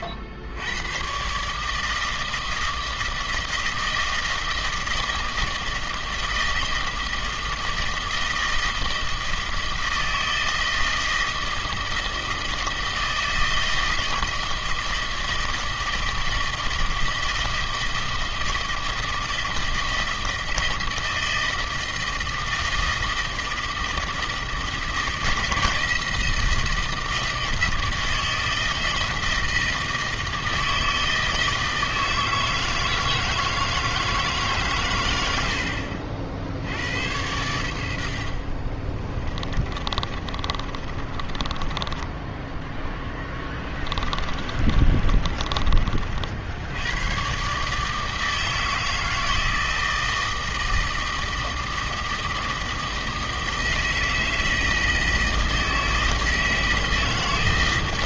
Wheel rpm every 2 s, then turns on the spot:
90, 160, 160, 160, 160, 160, 160, 160, 160, 160, 160, 160, 160, 160, 160, 160, 160, 140, 70, 40, 30, 10, 30, 80, 160, 160, 160, 160, 160.
38-46